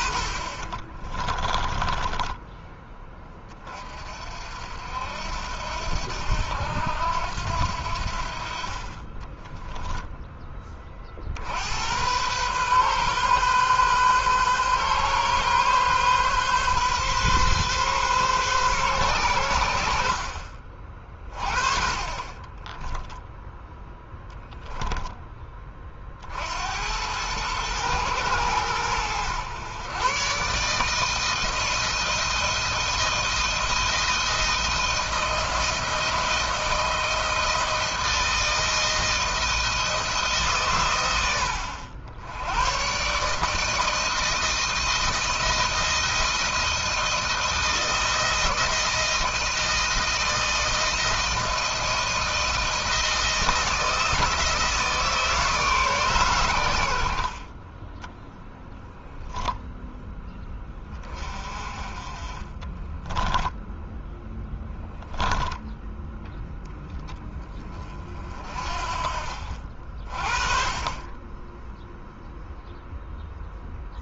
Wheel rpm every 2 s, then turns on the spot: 20, 10, 60, 80, 50, 20, 120, 130, 130, 130, 40, 20, 10, 70, 110, 140, 170, 160, 160, 160, 140, 100, 160, 170, 170, 170, 160, 160, 100, 0, 10, 20, 10, 10, 40, 30, 0.
0-2 22-24 62-66